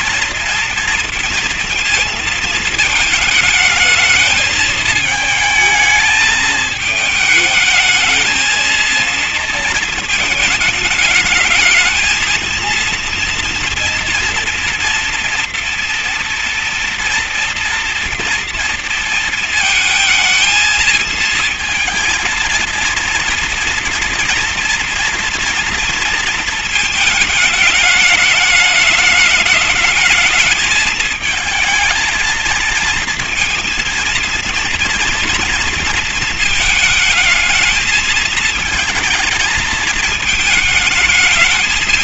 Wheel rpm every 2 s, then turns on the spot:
230, 230, 220, 220, 220, 220, 230, 230, 230, 230, 220, 230, 230, 220, 200, 210, 230, 230, 230, 220, 220.
none